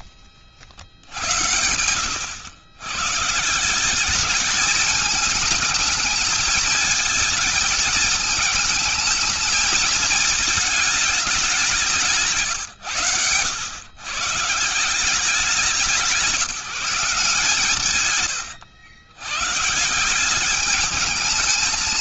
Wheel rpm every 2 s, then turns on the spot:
70, 110, 210, 220, 220, 220, 140, 150, 170, 120, 200.
none